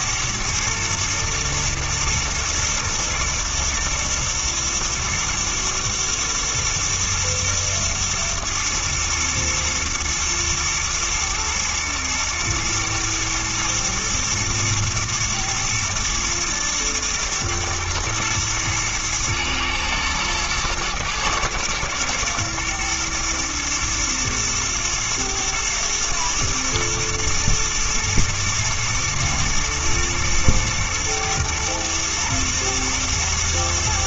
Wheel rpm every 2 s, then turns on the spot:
120, 110, 110, 120, 110, 110, 110, 110, 120, 110, 120, 120, 110, 110, 110, 120, 110.
none